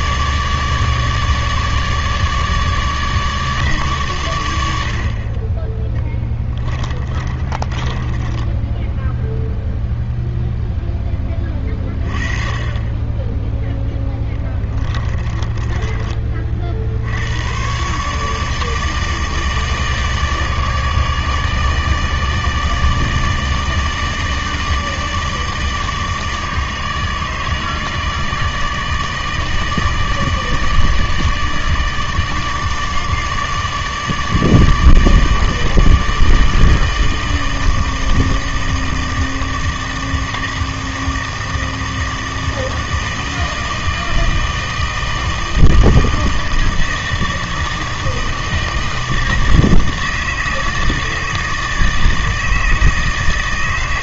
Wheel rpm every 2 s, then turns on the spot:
150, 150, 70, 20, 10, 0, 20, 20, 50, 150, 150, 150, 150, 150, 150, 150, 150, 150, 160, 160, 160, 160, 160, 160, 160, 160, 160.
6-10 14-16